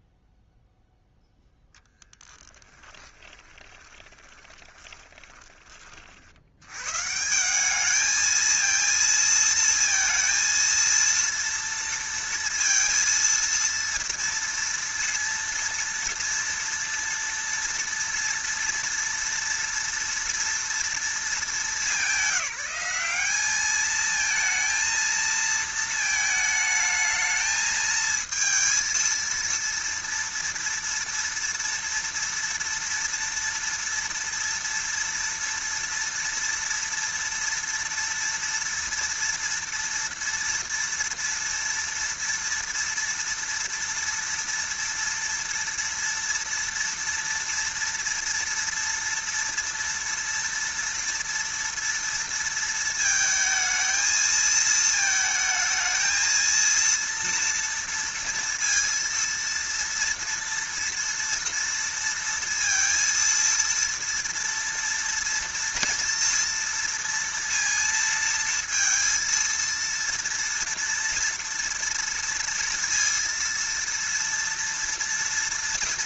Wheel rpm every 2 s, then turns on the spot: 0, 20, 20, 160, 230, 230, 230, 230, 230, 230, 220, 200, 230, 220, 230, 230, 230, 230, 230, 230, 230, 230, 230, 230, 230, 230, 220, 220, 230, 230, 230, 230, 230, 230, 230, 230, 230, 230.
2-6